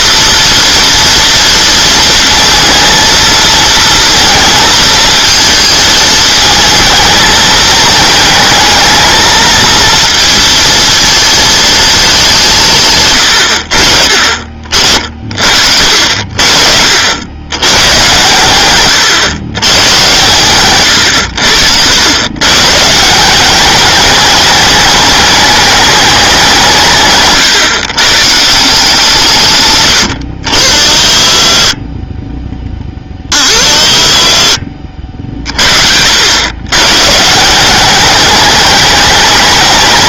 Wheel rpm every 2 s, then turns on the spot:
230, 230, 220, 220, 220, 230, 150, 50, 60, 120, 110, 150, 210, 160, 160, 70, 10, 50, 110, 210.
34-36